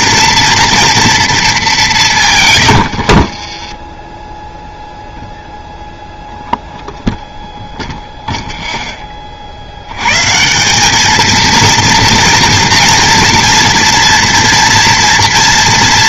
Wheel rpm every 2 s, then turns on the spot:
230, 110, 0, 0, 0, 180, 230, 230.
2-4